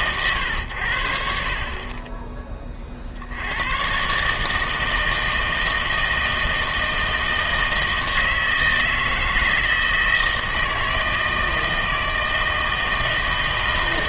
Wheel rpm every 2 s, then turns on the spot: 90, 30, 160, 160, 160, 160, 160.
none